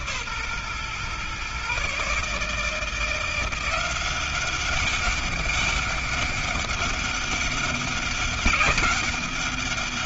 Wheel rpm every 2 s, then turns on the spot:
130, 160, 190, 200, 200.
none